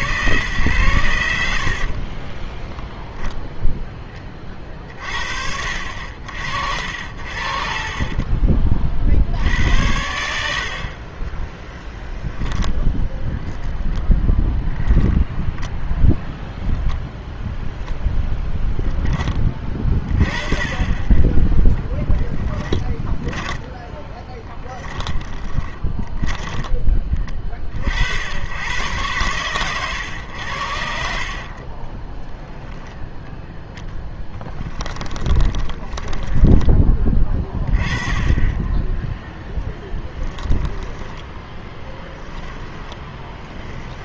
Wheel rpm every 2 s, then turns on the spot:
110, 20, 40, 60, 30, 40, 0, 0, 0, 0, 30, 10, 30, 10, 90, 100, 20, 10, 10, 20, 20, 10.
2-4 22-28 32-36 40-44